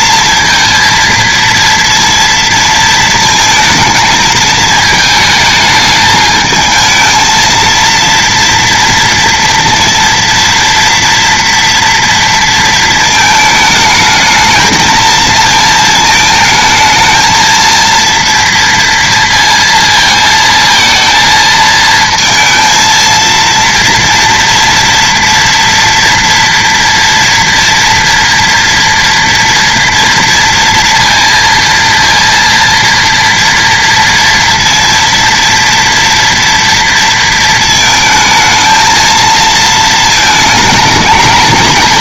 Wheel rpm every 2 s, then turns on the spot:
230, 230, 220, 220, 230, 230, 220, 230, 220, 230, 230, 230, 240, 230, 230, 230, 230, 230, 230, 220, 220.
none